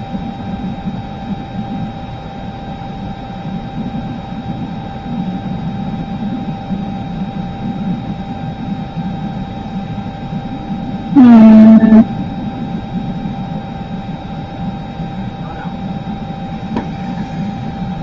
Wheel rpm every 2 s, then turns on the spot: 0, 0, 0, 0, 0, 0, 0, 0, 0.
none